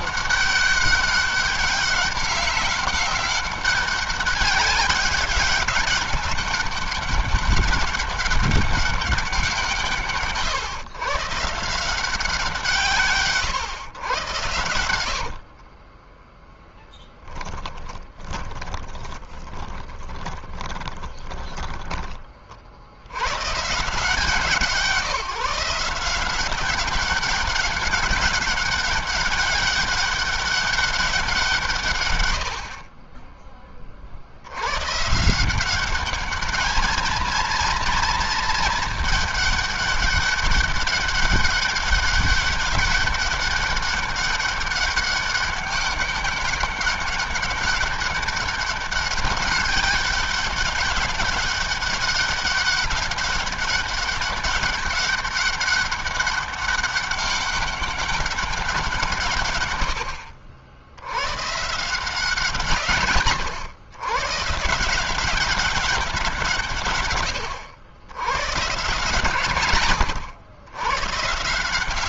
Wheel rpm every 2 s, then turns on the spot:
200, 190, 190, 200, 200, 130, 160, 100, 10, 20, 20, 60, 170, 190, 190, 190, 50, 120, 220, 220, 200, 200, 200, 200, 200, 200, 200, 200, 200, 180, 70, 140, 150, 140, 140, 110.
14-16 18-22